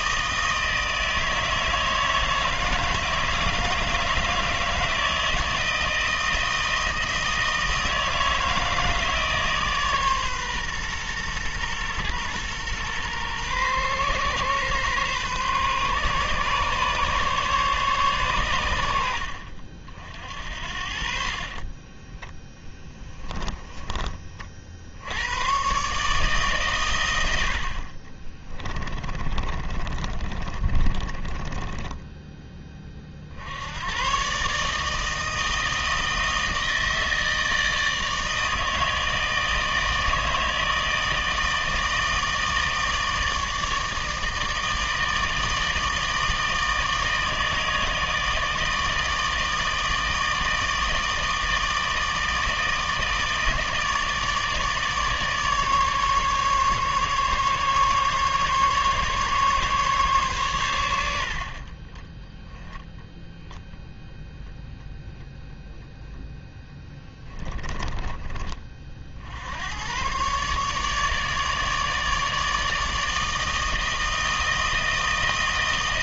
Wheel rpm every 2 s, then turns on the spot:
160, 160, 160, 160, 160, 130, 120, 130, 140, 90, 60, 10, 70, 120, 20, 30, 20, 150, 160, 160, 160, 160, 160, 160, 160, 160, 160, 150, 150, 140, 110, 10, 0, 10, 40, 150, 160, 160.
22-24 28-32 66-68